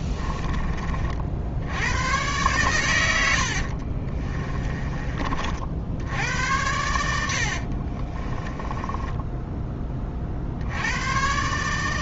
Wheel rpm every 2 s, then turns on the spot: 40, 100, 20, 80, 20, 100.
6-10